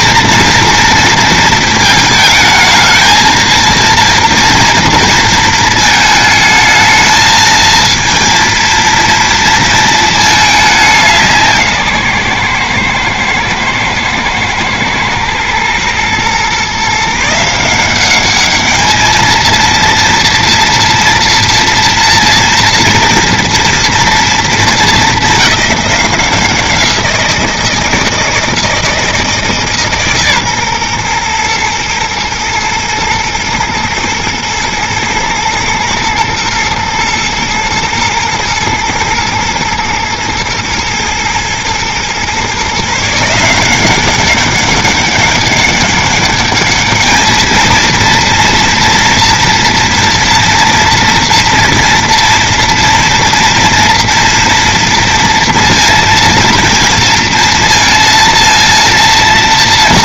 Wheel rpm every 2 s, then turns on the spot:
230, 220, 230, 220, 230, 200, 120, 110, 140, 220, 240, 230, 220, 180, 160, 130, 120, 110, 120, 110, 110, 140, 200, 210, 230, 230, 230, 230, 230, 230.
none